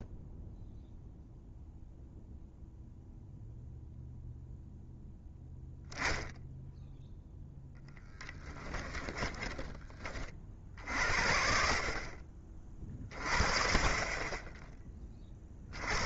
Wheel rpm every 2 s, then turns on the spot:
0, 0, 0, 0, 10, 50, 30, 20.
8-10